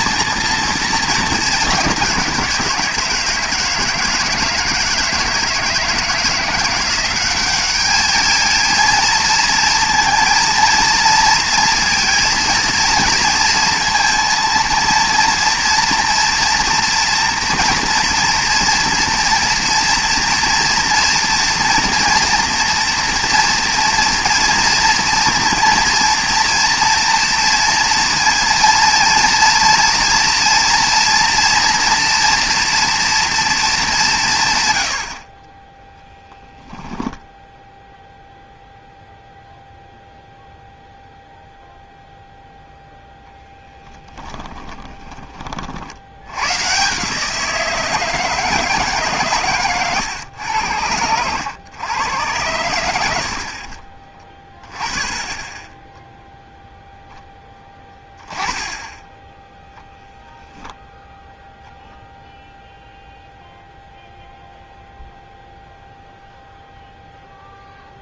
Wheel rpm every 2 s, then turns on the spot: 220, 170, 160, 180, 230, 230, 230, 230, 230, 240, 240, 240, 230, 230, 230, 230, 230, 100, 10, 0, 0, 0, 20, 150, 150, 90, 80, 20, 0, 10, 0, 0, 0, 0.
36-38 44-46